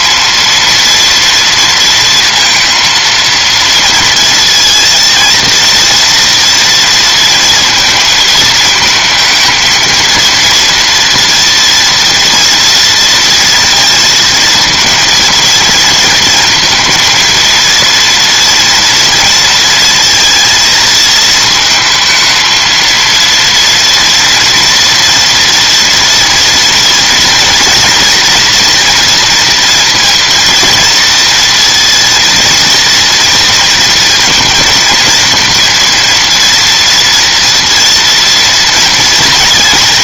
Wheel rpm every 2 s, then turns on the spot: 230, 230, 230, 230, 220, 230, 230, 230, 230, 230, 230, 230, 230, 230, 230, 230, 230, 230, 230, 240.
none